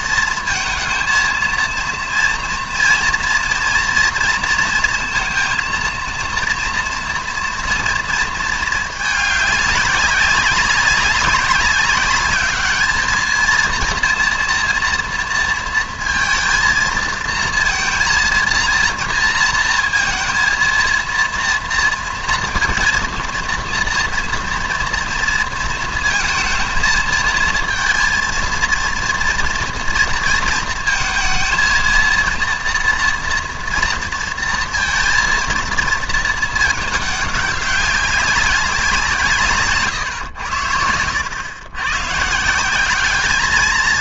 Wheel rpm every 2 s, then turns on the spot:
220, 230, 230, 230, 220, 190, 210, 230, 230, 230, 230, 230, 230, 220, 230, 230, 230, 230, 220, 190, 90, 170.
none